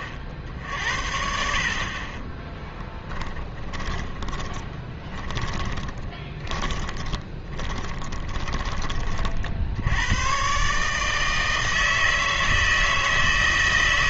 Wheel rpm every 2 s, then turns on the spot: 50, 10, 30, 20, 20, 140, 160.
2-10